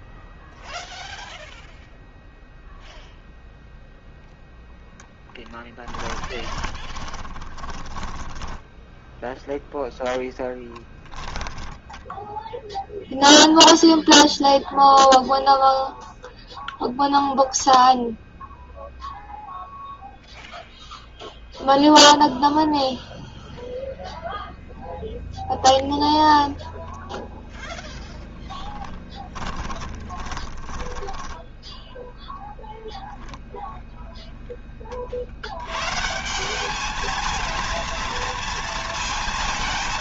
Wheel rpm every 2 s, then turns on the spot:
0, 0, 0, 20, 10, 10, 0, 0, 0, 0, 0, 0, 0, 0, 20, 10, 0, 10, 190, 230.
6-12 30-32